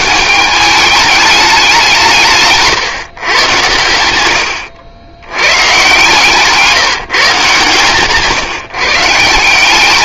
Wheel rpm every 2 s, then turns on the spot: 210, 140, 90, 170, 140.
4-6